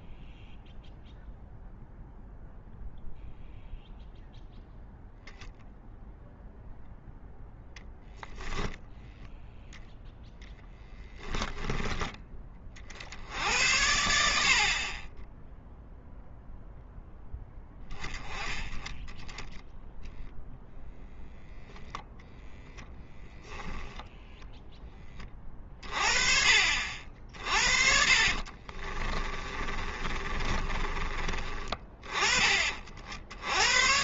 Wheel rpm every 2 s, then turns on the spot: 0, 0, 10, 0, 0, 10, 40, 50, 0, 20, 0, 10, 10, 50, 40, 30, 40.
10-12 28-32